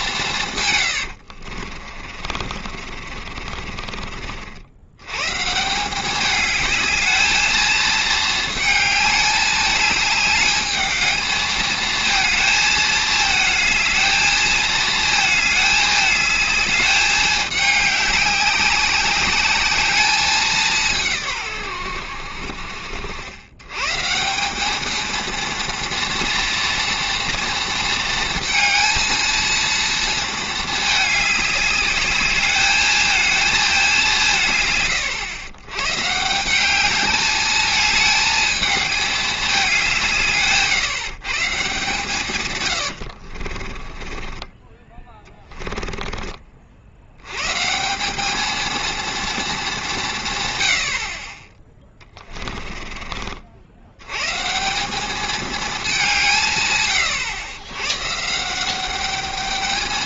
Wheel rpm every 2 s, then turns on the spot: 130, 40, 70, 210, 210, 210, 220, 220, 210, 200, 190, 60, 200, 240, 230, 220, 210, 140, 190, 210, 150, 120, 20, 50, 220, 100, 20, 170, 150, 180.
2-4 44-46 52-54